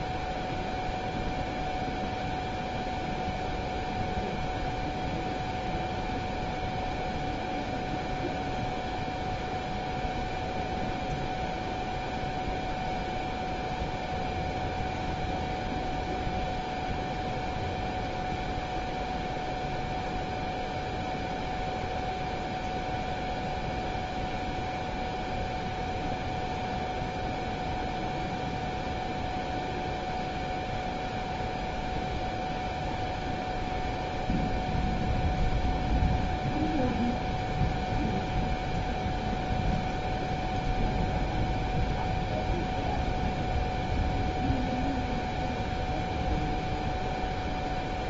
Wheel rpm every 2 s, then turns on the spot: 0, 0, 0, 0, 0, 0, 0, 0, 0, 0, 0, 0, 0, 0, 0, 0, 0, 0, 0, 0, 0, 0, 0, 0.
none